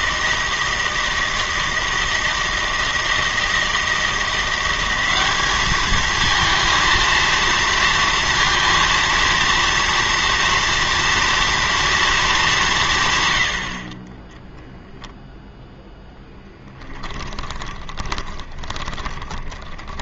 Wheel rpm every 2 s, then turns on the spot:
160, 160, 190, 230, 230, 230, 170, 0, 10, 20.
16-20